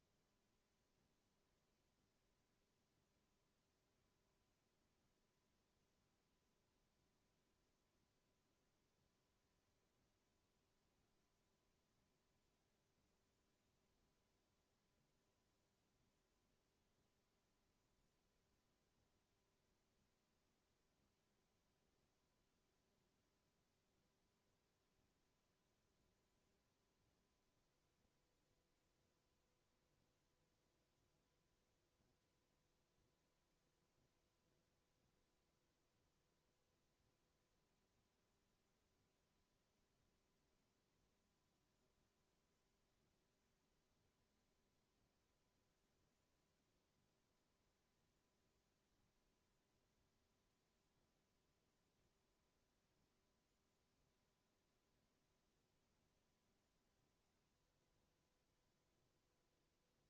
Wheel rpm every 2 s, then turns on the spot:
0, 0, 0, 0, 0, 0, 0, 0, 0, 0, 0, 0, 0, 0, 0, 0, 0, 0, 0, 0, 0, 0, 0, 0, 0, 0, 0, 0, 0, 0.
none